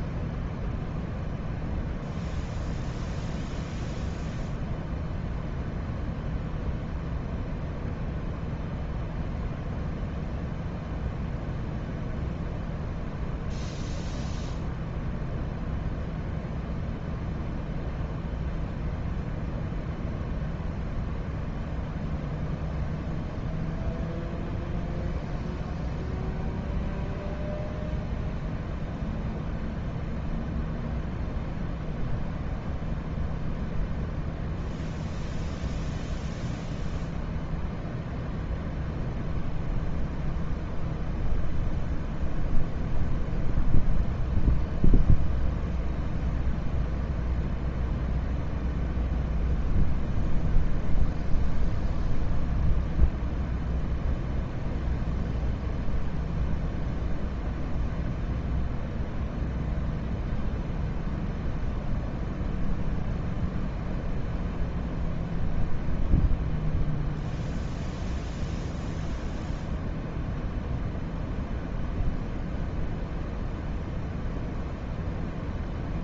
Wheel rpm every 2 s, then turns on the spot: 0, 0, 0, 0, 0, 0, 0, 0, 0, 0, 0, 0, 0, 0, 0, 0, 0, 0, 0, 0, 0, 0, 0, 0, 0, 0, 0, 0, 0, 0, 0, 0, 0, 0, 0, 0, 0, 0.
none